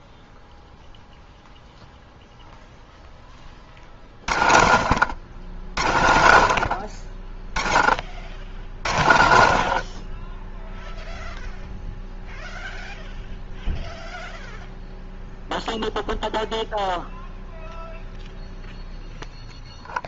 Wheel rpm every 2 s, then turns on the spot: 0, 0, 80, 80, 60, 10, 0, 0, 0, 0.
none